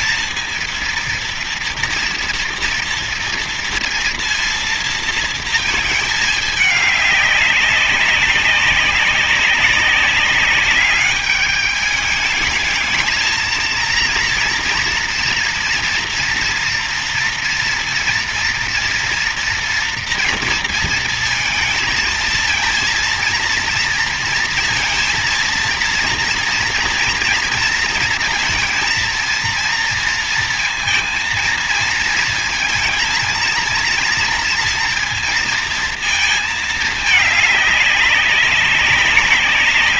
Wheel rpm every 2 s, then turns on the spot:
230, 230, 230, 210, 190, 200, 210, 230, 240, 230, 230, 230, 230, 240, 230, 230, 230, 230, 220, 200.
none